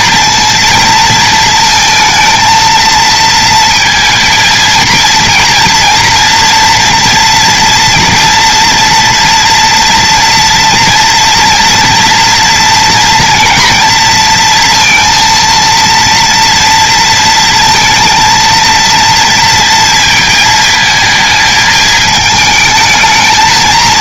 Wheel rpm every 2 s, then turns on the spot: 230, 230, 230, 230, 230, 230, 230, 230, 230, 230, 220, 220.
none